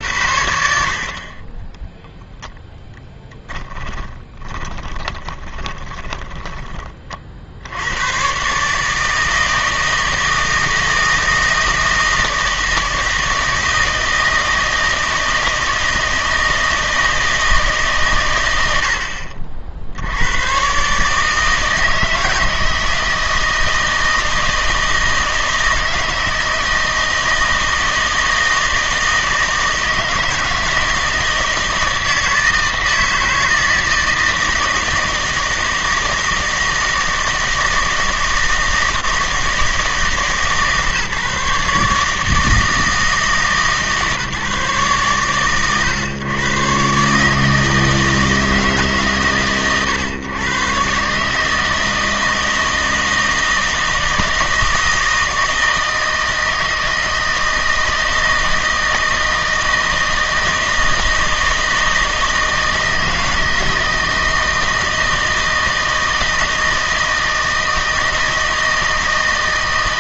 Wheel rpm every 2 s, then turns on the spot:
70, 0, 20, 30, 150, 160, 160, 160, 160, 70, 130, 160, 160, 160, 160, 160, 160, 160, 160, 160, 150, 160, 140, 130, 150, 130, 160, 160, 160, 160, 160, 160, 160, 160, 160.
4-6